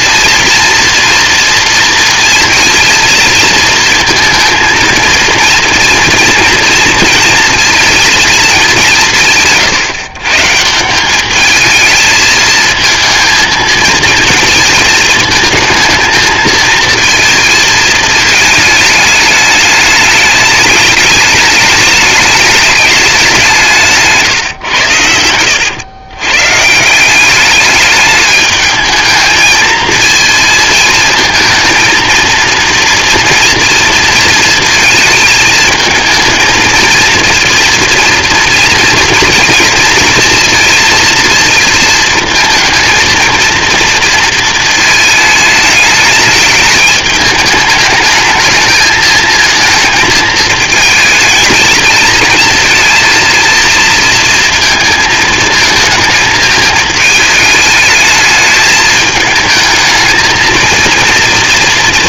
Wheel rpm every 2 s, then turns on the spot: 230, 230, 230, 230, 180, 190, 220, 220, 220, 220, 210, 200, 100, 180, 210, 220, 230, 220, 230, 230, 230, 230, 220, 210, 220, 220, 230, 230, 220, 220, 230.
none